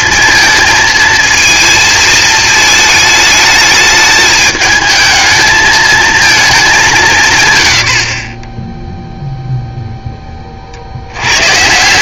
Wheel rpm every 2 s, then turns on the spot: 220, 220, 220, 210, 20, 30.
none